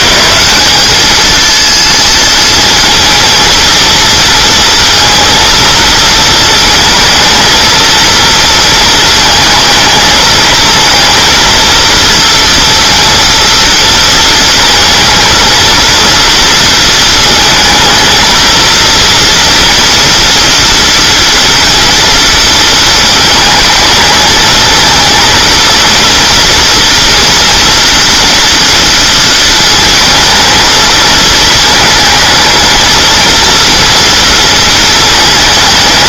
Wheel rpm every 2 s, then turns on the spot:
190, 230, 230, 220, 230, 230, 230, 230, 230, 230, 230, 220, 220, 230, 240, 220, 230, 230.
none